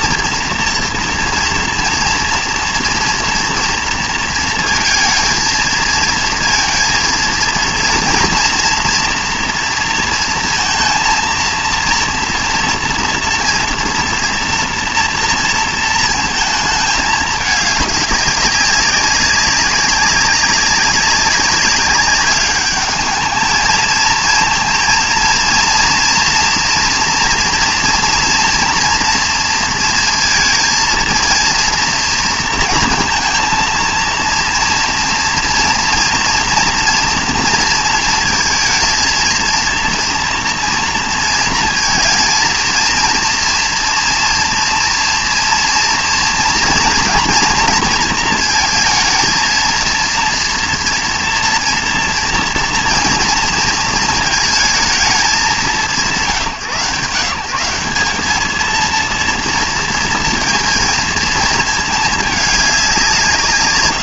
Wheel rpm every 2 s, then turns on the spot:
230, 240, 230, 230, 230, 230, 230, 240, 220, 200, 190, 210, 230, 240, 230, 220, 230, 230, 230, 230, 240, 230, 230, 230, 230, 240, 230, 220, 150, 220, 230, 210.
none